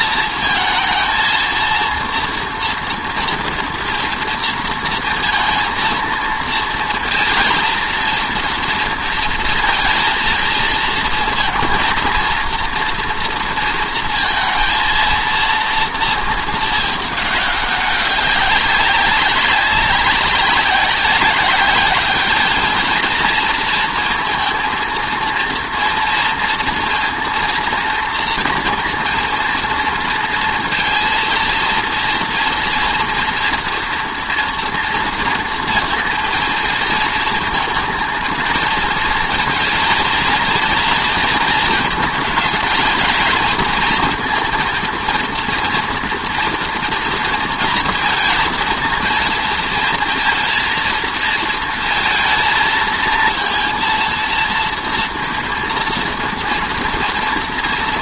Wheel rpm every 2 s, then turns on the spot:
230, 230, 230, 230, 230, 230, 230, 230, 220, 200, 190, 220, 230, 230, 230, 230, 230, 230, 220, 230, 230, 220, 230, 230, 230, 230, 230, 230, 230.
none